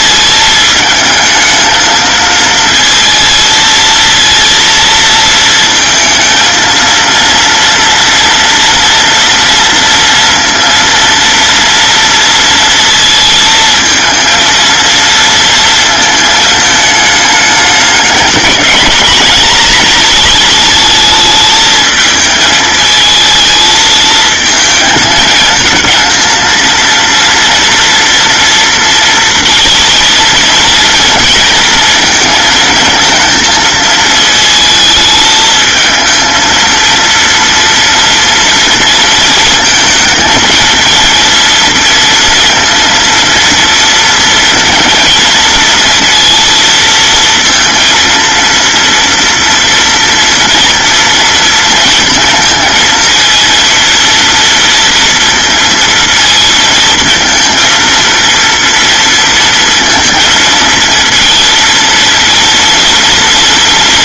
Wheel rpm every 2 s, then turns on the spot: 220, 230, 230, 230, 230, 230, 230, 230, 220, 210, 220, 220, 220, 230, 230, 230, 230, 220, 230, 230, 230, 230, 230, 230, 230, 230, 230, 230, 230, 230, 230, 230.
none